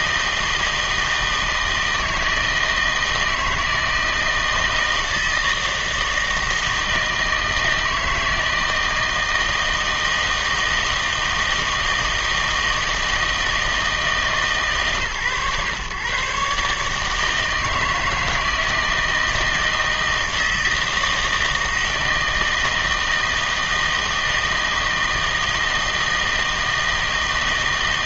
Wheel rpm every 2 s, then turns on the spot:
160, 160, 160, 160, 160, 160, 160, 140, 150, 160, 160, 160, 160, 160.
none